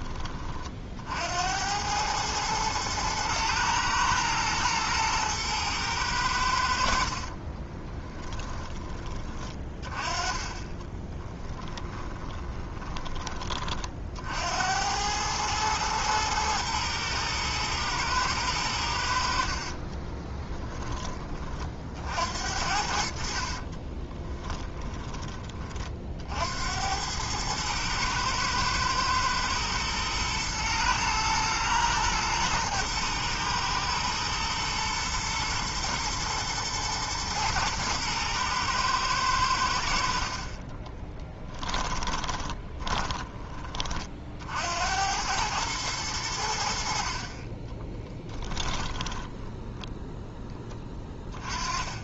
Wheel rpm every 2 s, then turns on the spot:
60, 110, 110, 60, 20, 20, 20, 90, 110, 80, 10, 60, 20, 90, 110, 110, 110, 120, 110, 110, 20, 20, 80, 60, 20, 20.
10-12 40-44 48-50